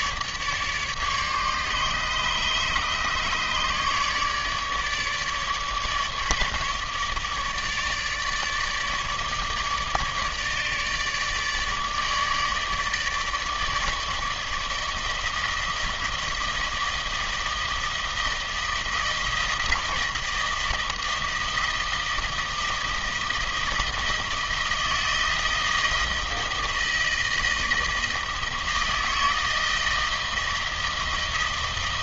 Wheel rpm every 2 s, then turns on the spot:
150, 150, 150, 150, 150, 150, 150, 160, 160, 160, 160, 160, 160, 160, 160, 160.
none